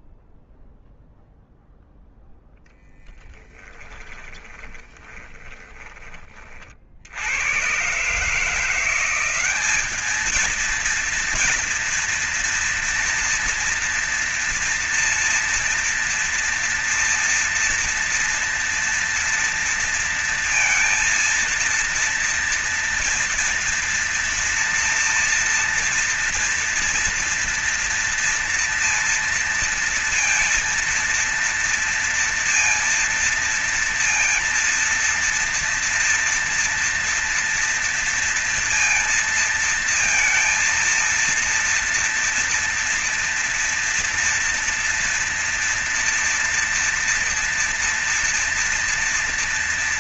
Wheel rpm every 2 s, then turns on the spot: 0, 0, 20, 30, 150, 220, 240, 240, 230, 230, 230, 230, 230, 230, 230, 230, 230, 230, 230, 230, 230, 230, 230, 240, 230.
4-6